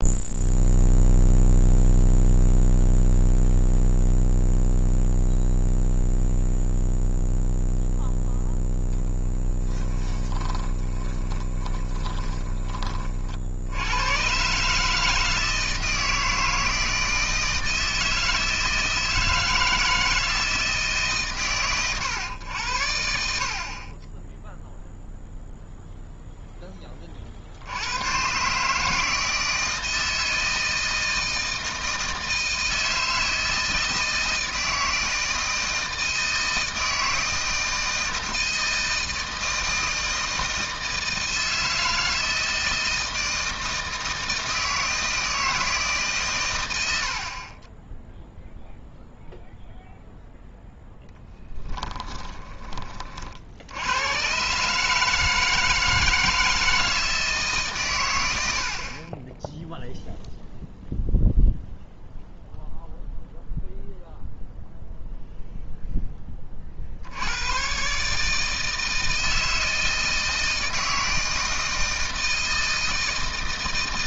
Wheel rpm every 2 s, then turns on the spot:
0, 0, 0, 0, 0, 20, 30, 150, 160, 160, 150, 80, 0, 20, 150, 160, 160, 160, 160, 160, 170, 160, 160, 90, 0, 0, 20, 150, 160, 50, 0, 0, 0, 50, 160, 160, 160.
10-12